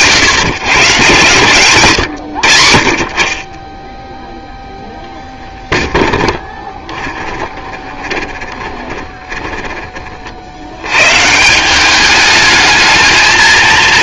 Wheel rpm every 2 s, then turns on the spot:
130, 60, 0, 20, 20, 100, 220.
6-10